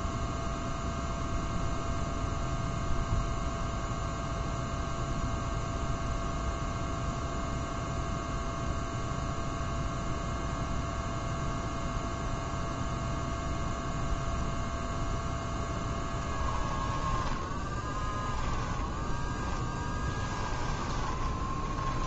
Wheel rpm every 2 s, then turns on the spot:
0, 0, 0, 0, 0, 0, 0, 0, 10, 10, 20.
16-18 20-22